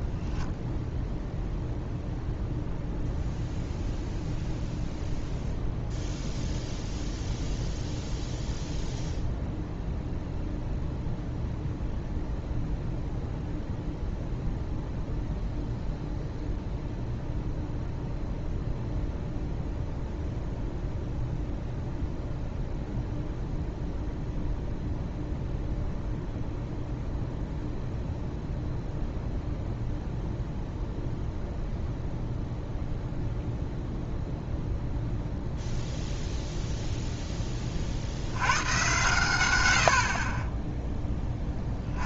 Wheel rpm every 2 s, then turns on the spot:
0, 0, 0, 0, 0, 0, 0, 0, 0, 0, 0, 0, 0, 0, 0, 0, 0, 0, 0, 110, 10.
none